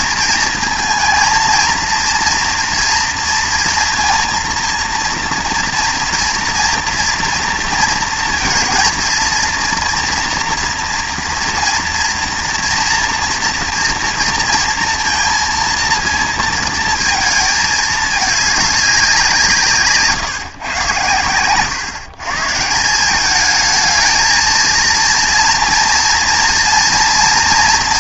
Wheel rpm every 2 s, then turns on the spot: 220, 230, 230, 230, 230, 230, 230, 230, 220, 210, 130, 150, 230, 230.
none